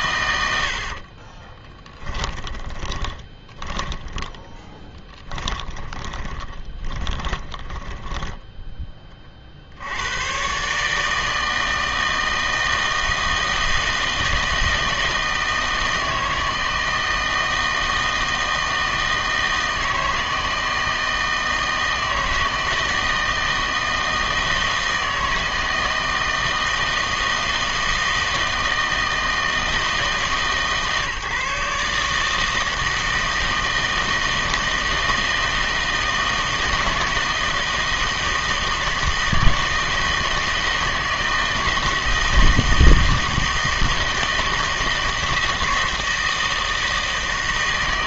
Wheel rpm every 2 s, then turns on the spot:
80, 20, 10, 20, 10, 140, 160, 160, 160, 160, 160, 160, 160, 160, 160, 150, 160, 160, 160, 160, 160, 160, 160, 160.
2-8